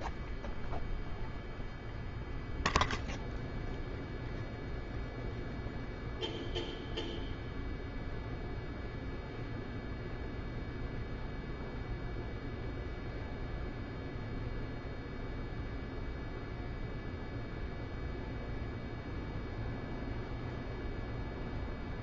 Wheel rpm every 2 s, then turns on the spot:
0, 0, 0, 0, 0, 0, 0, 0, 0, 0, 0.
none